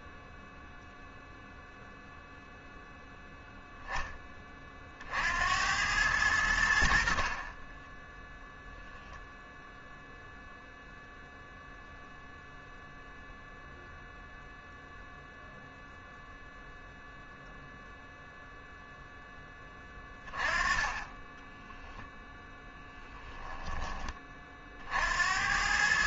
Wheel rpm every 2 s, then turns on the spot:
0, 0, 40, 70, 0, 0, 0, 0, 0, 0, 20, 10, 50.
none